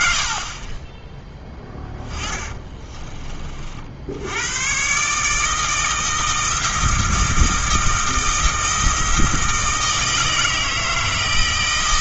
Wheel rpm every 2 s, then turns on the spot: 30, 40, 140, 160, 160, 160.
2-4